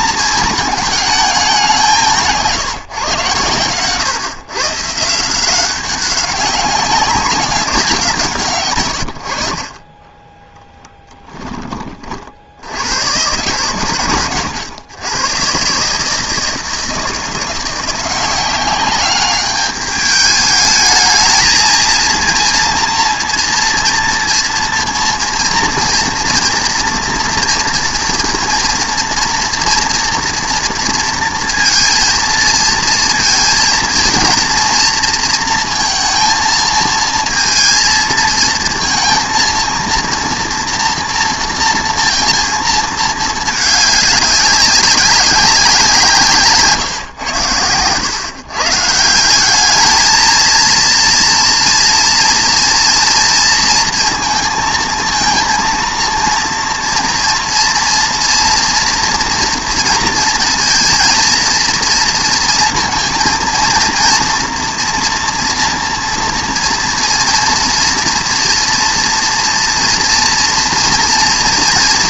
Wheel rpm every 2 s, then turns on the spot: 220, 150, 150, 190, 120, 10, 80, 110, 160, 190, 210, 230, 230, 240, 230, 230, 230, 230, 230, 230, 240, 220, 190, 140, 160, 230, 230, 230, 230, 240, 230, 230, 240, 230, 230, 230.
10-12